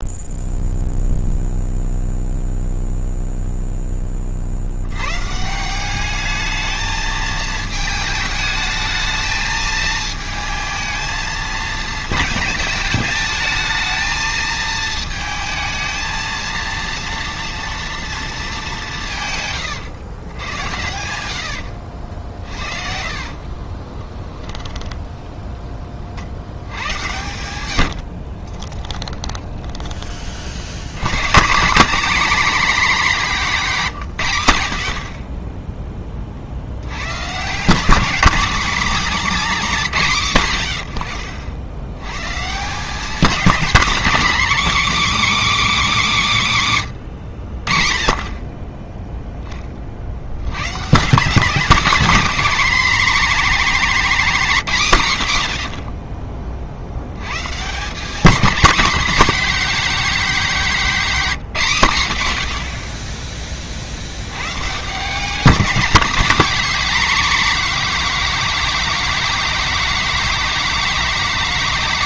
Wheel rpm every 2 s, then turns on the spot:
0, 0, 80, 220, 220, 220, 210, 220, 230, 190, 90, 50, 10, 80, 20, 60, 240, 90, 60, 250, 130, 170, 300, 190, 20, 120, 240, 210, 40, 220, 230, 60, 130, 240, 240, 240.
22-26 28-30